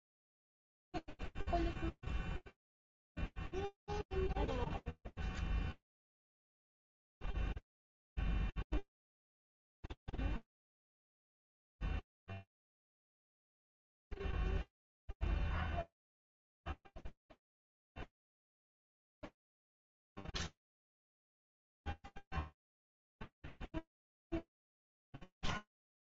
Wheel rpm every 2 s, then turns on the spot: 0, 0, 0, 0, 0, 0, 0, 0, 0, 0, 0, 0, 0.
none